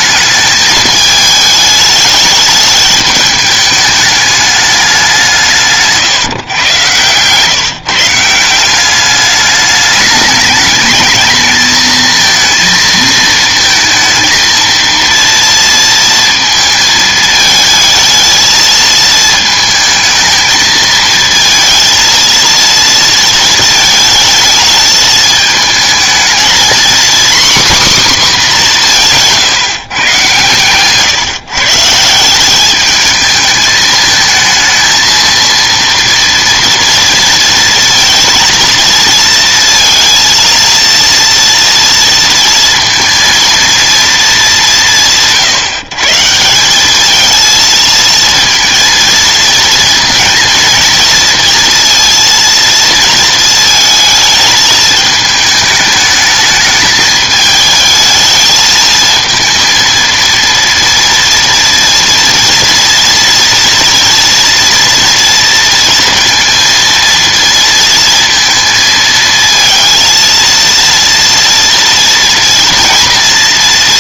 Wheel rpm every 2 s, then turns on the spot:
210, 210, 210, 130, 180, 210, 230, 230, 230, 220, 220, 230, 220, 240, 210, 130, 200, 220, 230, 230, 230, 230, 200, 180, 230, 220, 230, 220, 220, 220, 230, 230, 230, 230, 230, 230, 230.
none